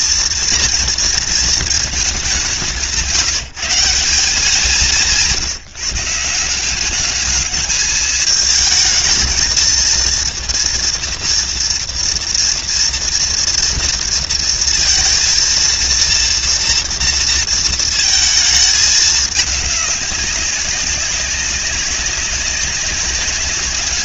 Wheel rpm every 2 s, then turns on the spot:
230, 180, 180, 210, 220, 230, 230, 230, 230, 210, 190, 190.
none